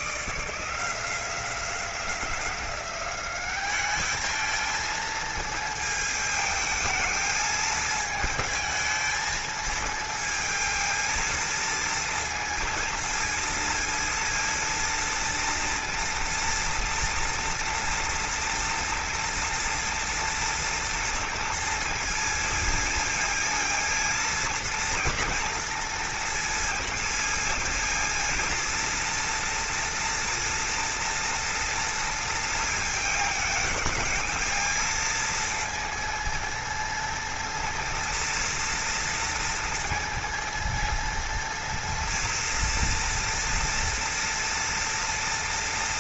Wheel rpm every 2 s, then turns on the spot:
170, 190, 220, 220, 220, 230, 230, 230, 230, 230, 230, 230, 230, 230, 230, 230, 220, 230, 230, 230, 230, 230, 230.
none